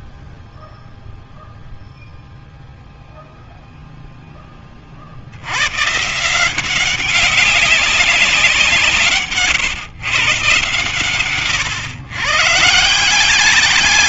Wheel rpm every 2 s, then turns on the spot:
0, 0, 100, 190, 140, 130, 180.
none